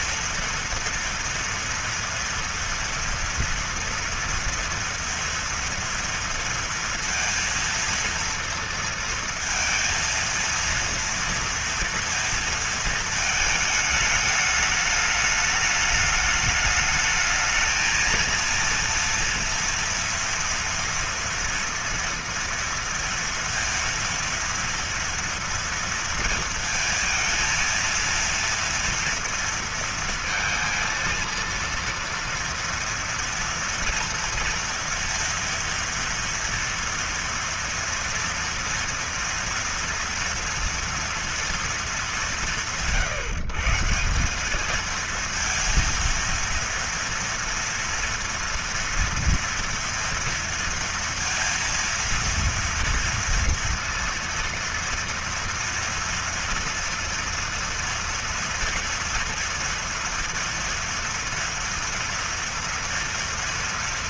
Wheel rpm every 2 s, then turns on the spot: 230, 230, 230, 230, 230, 230, 230, 210, 210, 230, 230, 230, 230, 230, 230, 230, 230, 230, 230, 230, 230, 160, 220, 240, 230, 230, 230, 230, 230, 230, 230, 230.
none